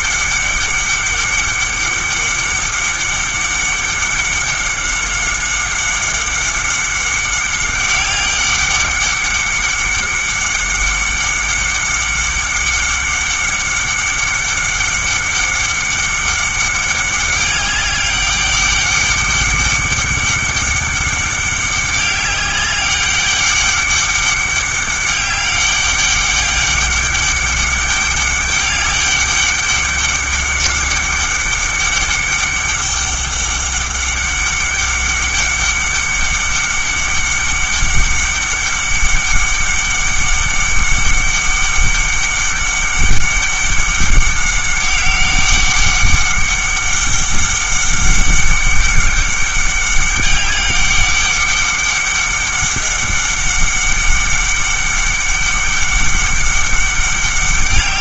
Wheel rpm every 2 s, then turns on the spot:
200, 200, 200, 200, 200, 200, 190, 200, 200, 200, 200, 200, 200, 200, 200, 200, 200, 200, 200, 200, 200, 200, 190, 200, 200, 200, 200, 200, 200.
none